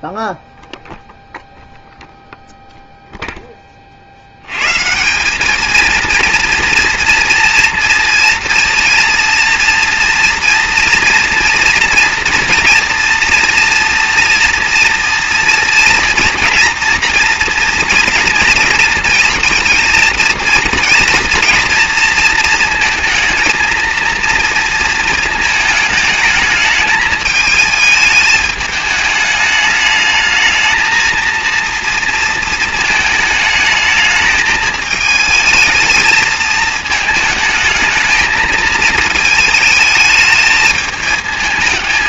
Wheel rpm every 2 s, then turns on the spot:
0, 0, 170, 230, 230, 230, 230, 230, 240, 230, 230, 220, 230, 220, 210, 230, 220, 220, 220, 220, 220.
none